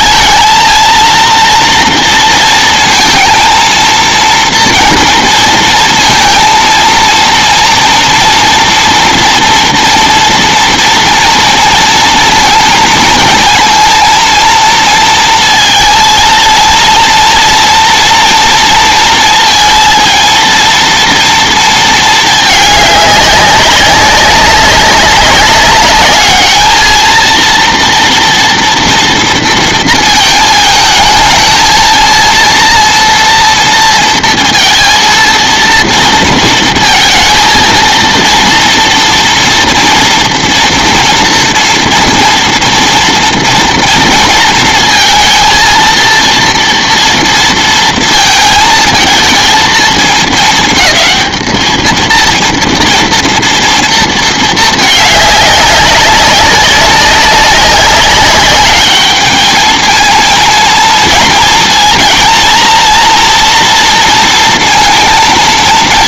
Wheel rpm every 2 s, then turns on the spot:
230, 230, 230, 230, 230, 230, 230, 230, 230, 230, 230, 210, 190, 220, 230, 220, 230, 230, 230, 230, 240, 230, 230, 230, 220, 220, 230, 210, 190, 200, 230, 230, 230.
none